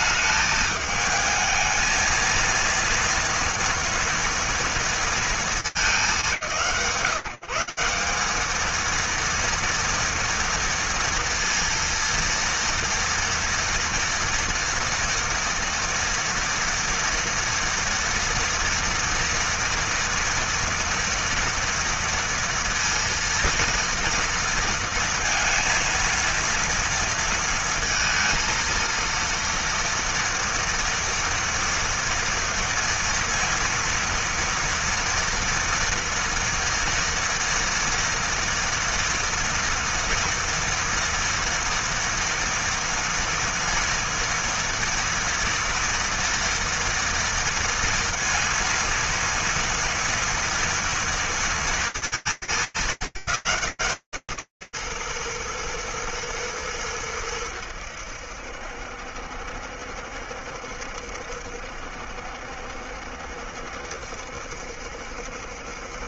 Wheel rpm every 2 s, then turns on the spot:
220, 230, 200, 180, 230, 230, 230, 230, 230, 240, 240, 230, 230, 230, 230, 240, 240, 230, 230, 230, 230, 230, 230, 230, 230, 230, 150, 130, 110, 70, 70, 70, 70.
none